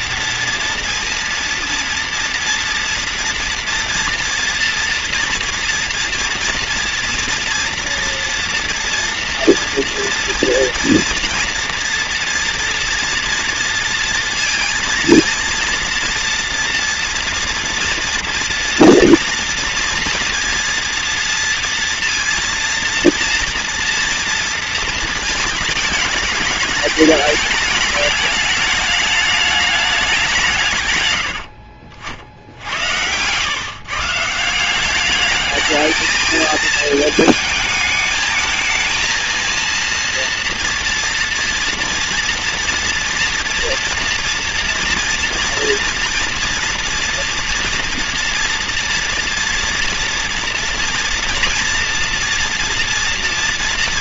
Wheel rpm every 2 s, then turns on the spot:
230, 230, 230, 230, 240, 230, 240, 230, 230, 230, 240, 230, 230, 210, 210, 160, 80, 190, 220, 220, 230, 230, 230, 230, 230, 230, 230.
none